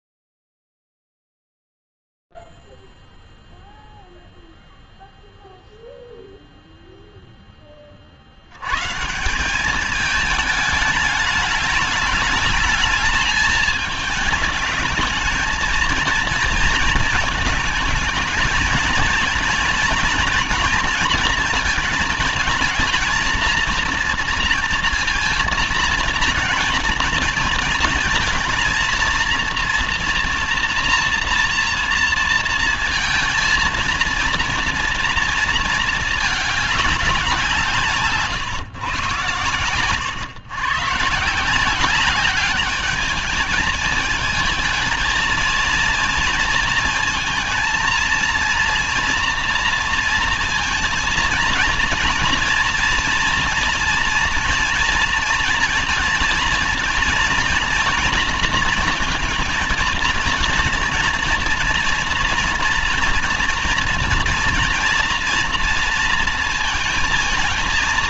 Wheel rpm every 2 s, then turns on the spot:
0, 0, 0, 0, 50, 210, 210, 210, 230, 220, 230, 230, 230, 230, 230, 230, 230, 230, 220, 140, 130, 200, 220, 230, 230, 230, 230, 230, 220, 230, 230, 230, 240, 220.
none